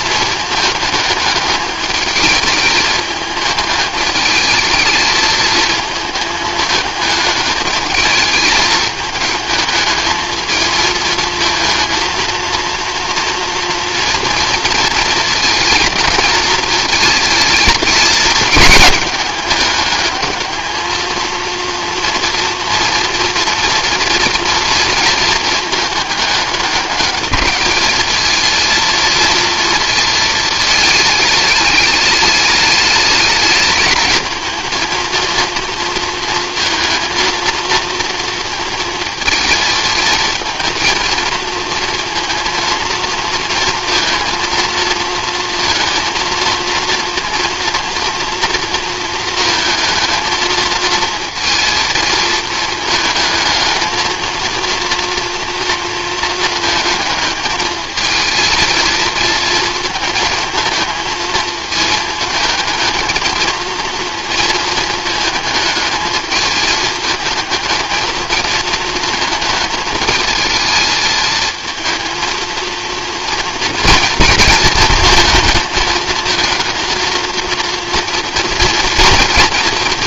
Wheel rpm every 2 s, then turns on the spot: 210, 210, 220, 210, 220, 220, 230, 230, 220, 210, 220, 230, 230, 210, 230, 220, 210, 220, 230, 230, 230, 230, 230, 230, 230, 230, 220, 230, 220, 220, 220, 220, 220, 220, 220, 220, 230, 230, 230, 230.
none